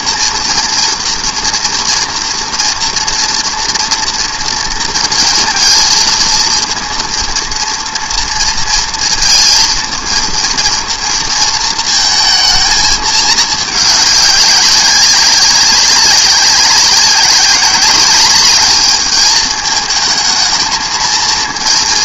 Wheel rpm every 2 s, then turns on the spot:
230, 240, 230, 230, 230, 230, 220, 200, 190, 210, 220.
none